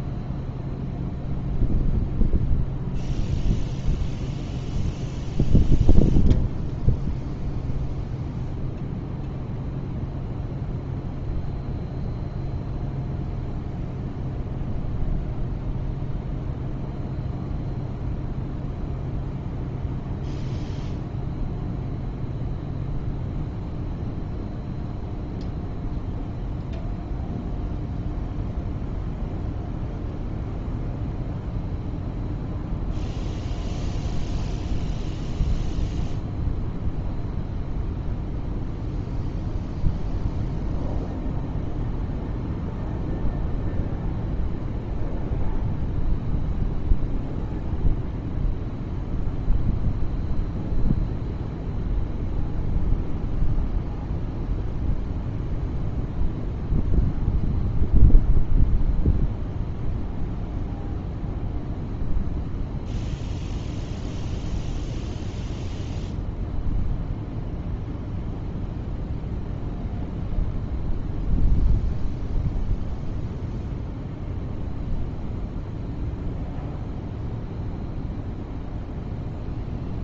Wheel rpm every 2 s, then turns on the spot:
0, 0, 0, 0, 0, 0, 0, 0, 0, 0, 0, 0, 0, 0, 0, 0, 0, 0, 0, 0, 0, 0, 0, 0, 0, 0, 0, 0, 0, 0, 0, 0, 0, 0, 0, 0, 0, 0, 0, 0.
none